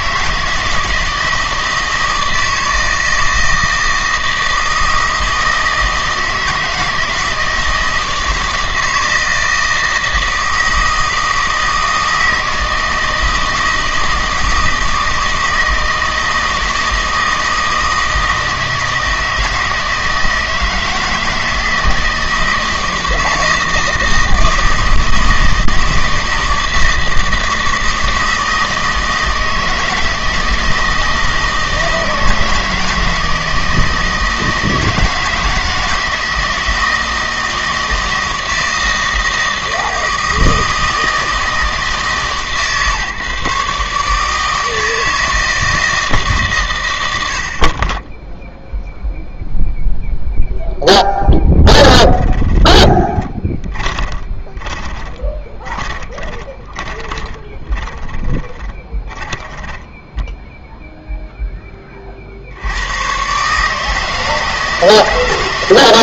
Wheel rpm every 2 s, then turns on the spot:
160, 160, 160, 160, 160, 160, 160, 160, 160, 160, 160, 160, 160, 160, 160, 160, 160, 160, 170, 160, 160, 140, 160, 120, 0, 0, 20, 20, 20, 20, 0, 80, 160.
52-60